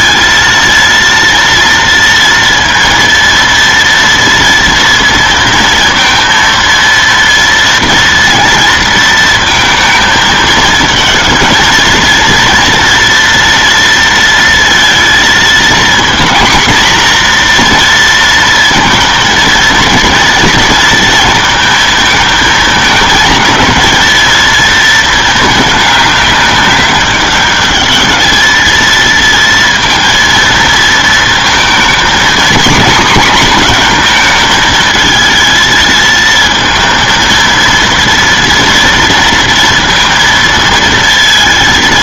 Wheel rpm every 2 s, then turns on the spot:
230, 230, 230, 230, 230, 220, 230, 230, 240, 230, 230, 220, 230, 200, 220, 230, 240, 220, 220, 230, 230.
none